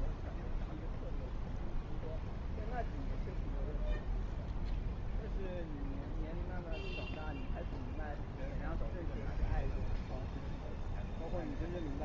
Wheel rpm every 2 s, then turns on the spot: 0, 0, 0, 0, 0, 0.
none